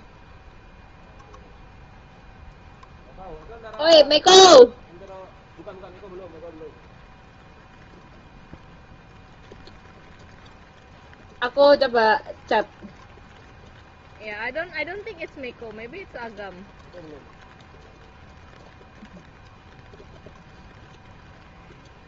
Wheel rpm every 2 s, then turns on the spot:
0, 0, 0, 0, 0, 0, 0, 0, 0, 0, 0.
none